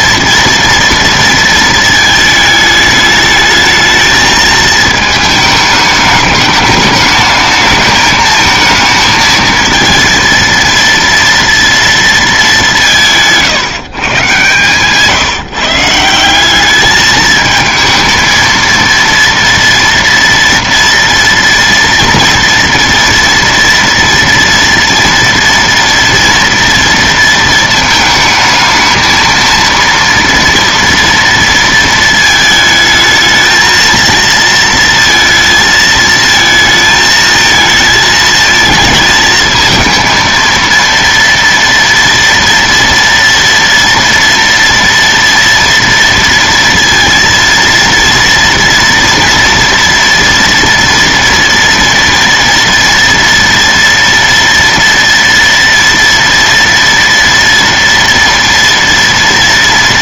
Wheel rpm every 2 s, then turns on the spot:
230, 220, 220, 210, 220, 230, 200, 140, 190, 230, 230, 230, 230, 230, 220, 230, 220, 230, 220, 220, 230, 230, 230, 230, 230, 230, 230, 230, 230, 230.
none